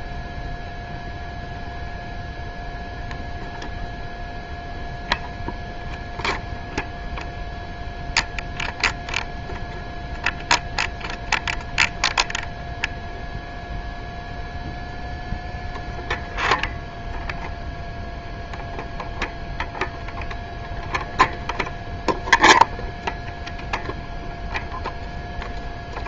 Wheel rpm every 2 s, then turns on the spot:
0, 0, 0, 0, 0, 0, 0, 0, 0, 0, 0, 0, 0.
none